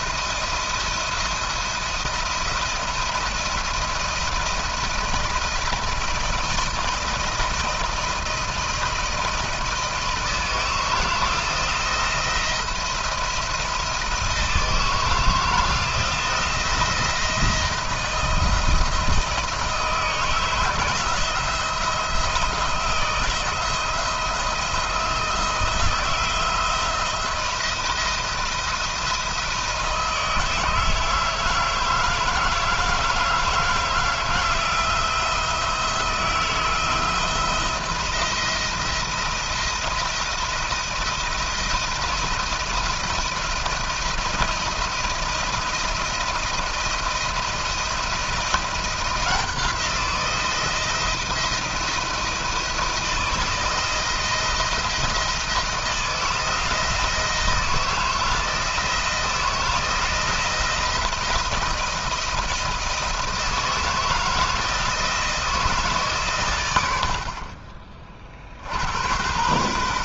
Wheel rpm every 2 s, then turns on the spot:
170, 170, 170, 170, 160, 160, 170, 160, 170, 160, 160, 160, 160, 170, 160, 160, 160, 170, 160, 170, 170, 170, 170, 170, 170, 170, 170, 170, 160, 160, 170, 170, 160, 80, 70.
none